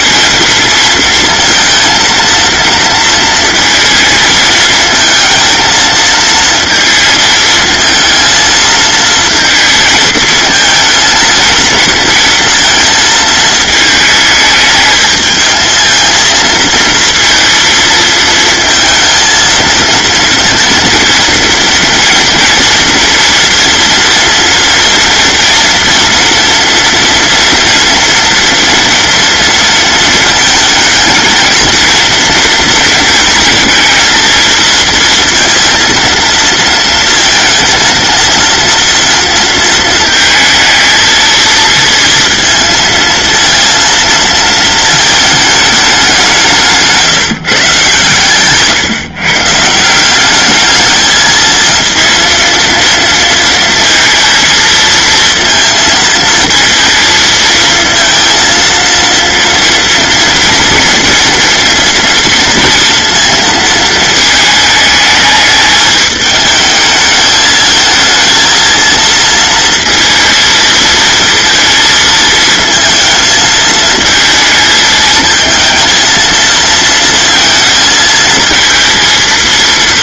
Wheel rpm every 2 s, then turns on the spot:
230, 230, 230, 230, 220, 220, 220, 220, 230, 230, 230, 240, 230, 230, 230, 220, 230, 230, 230, 230, 220, 230, 220, 160, 140, 220, 230, 220, 230, 230, 230, 230, 220, 220, 230, 230, 220, 220, 230, 230.
none